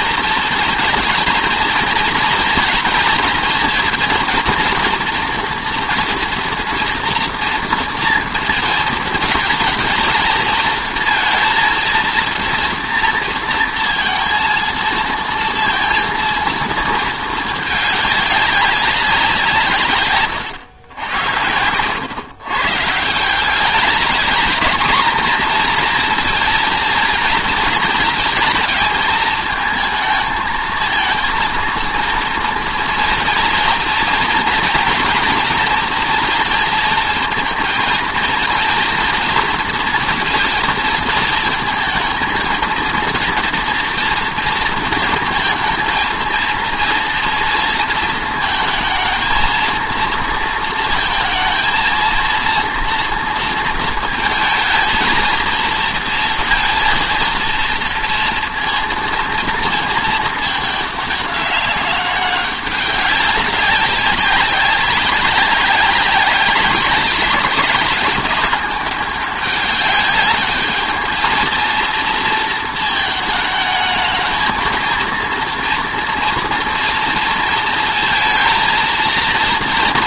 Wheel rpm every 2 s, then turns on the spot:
230, 230, 230, 230, 230, 230, 230, 230, 230, 200, 110, 130, 220, 230, 220, 220, 230, 230, 230, 230, 220, 220, 230, 230, 220, 230, 230, 220, 230, 230, 210, 200, 190, 190, 200, 210, 220, 230, 230, 230.
none